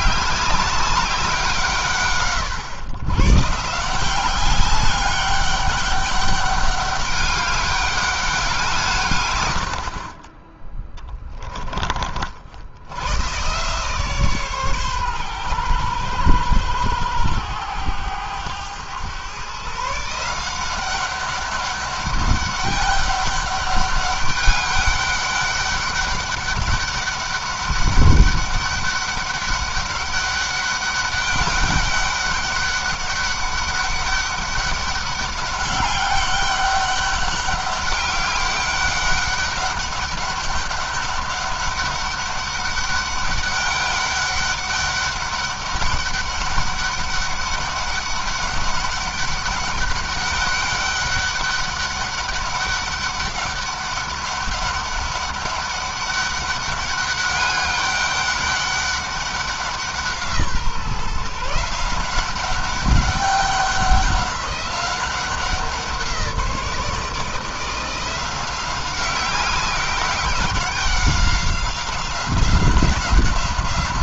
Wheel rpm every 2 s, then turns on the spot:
200, 120, 200, 200, 150, 10, 90, 130, 110, 110, 190, 200, 200, 200, 200, 200, 200, 200, 200, 200, 200, 200, 200, 200, 200, 200, 200, 200, 200, 200, 160, 190, 190, 170, 190, 190, 180.
10-12